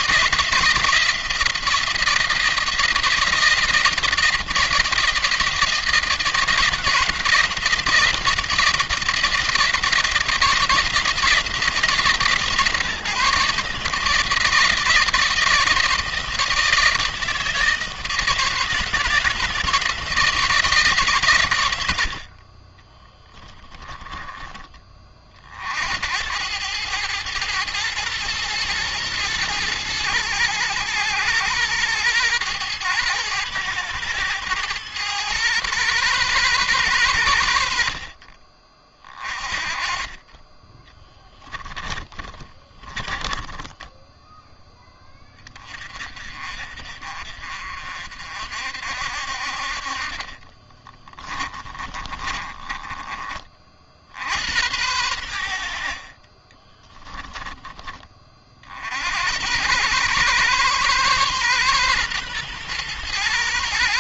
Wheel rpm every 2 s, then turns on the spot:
170, 170, 160, 170, 170, 160, 150, 160, 160, 160, 150, 20, 30, 110, 110, 110, 110, 110, 110, 40, 20, 20, 10, 40, 60, 30, 20, 90, 20, 70, 130, 120.
22-24 40-44 50-54 56-58